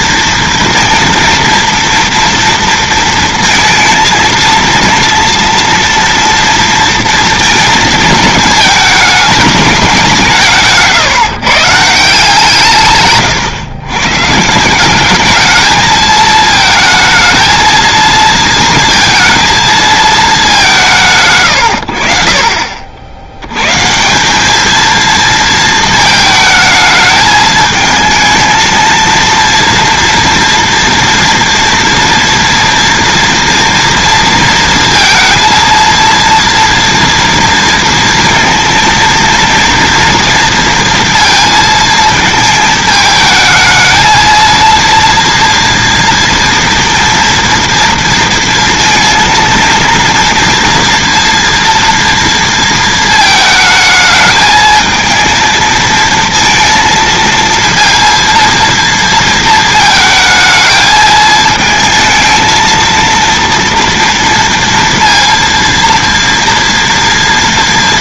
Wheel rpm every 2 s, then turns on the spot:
230, 230, 230, 230, 220, 150, 150, 170, 220, 230, 180, 50, 210, 220, 230, 240, 230, 230, 230, 230, 230, 220, 230, 230, 230, 240, 230, 220, 230, 230, 220, 220, 230, 230.
none